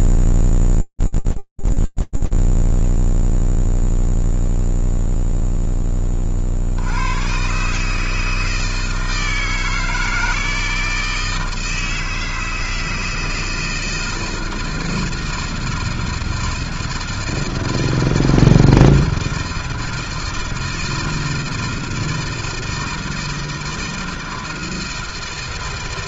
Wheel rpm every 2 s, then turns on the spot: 0, 0, 0, 110, 160, 160, 160, 160, 160, 160, 160, 160, 160.
none